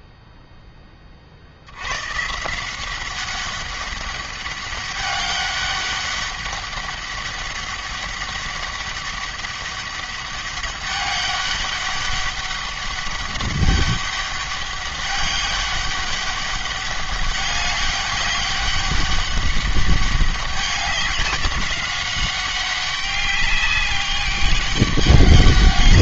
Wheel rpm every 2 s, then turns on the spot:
10, 180, 200, 200, 200, 200, 200, 200, 200, 200, 190, 190, 200.
none